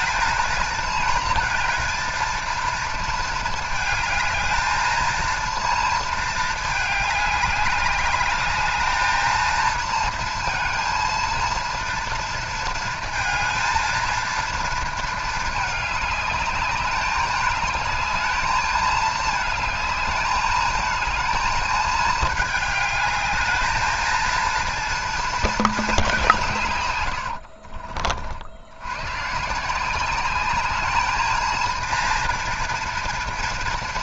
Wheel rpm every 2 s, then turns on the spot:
220, 230, 220, 210, 210, 230, 220, 230, 200, 220, 220, 210, 230, 130, 90, 210, 230.
26-28